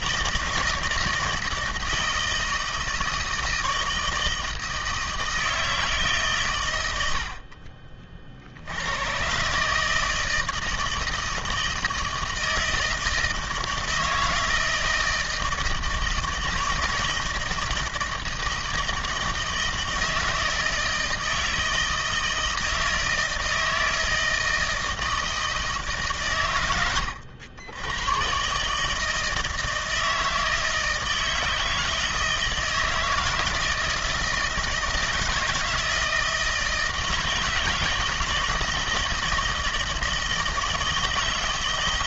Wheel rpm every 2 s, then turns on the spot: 160, 160, 160, 110, 80, 160, 160, 160, 160, 160, 160, 160, 160, 110, 150, 160, 160, 160, 160, 170, 160.
none